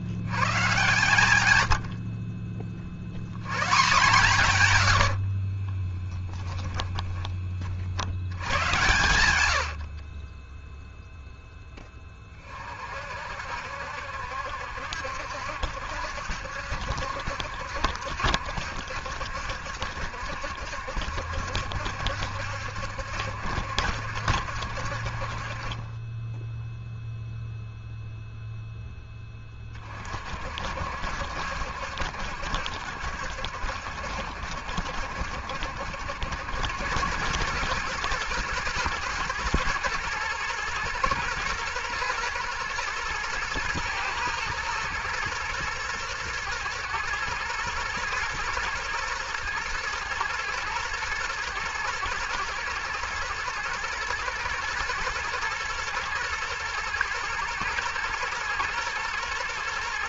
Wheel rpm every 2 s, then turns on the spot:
130, 40, 100, 20, 110, 10, 40, 70, 70, 70, 70, 70, 60, 0, 0, 60, 70, 70, 90, 110, 110, 120, 110, 110, 120, 110, 110, 110, 110, 120.
0-2 6-12